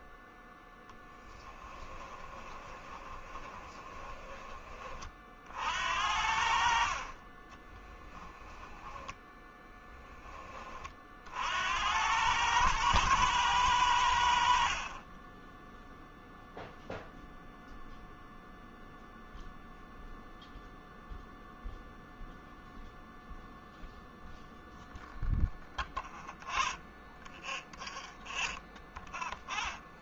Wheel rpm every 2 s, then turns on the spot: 10, 20, 30, 40, 10, 40, 110, 40, 0, 0, 0, 0, 0, 0, 0.
2-4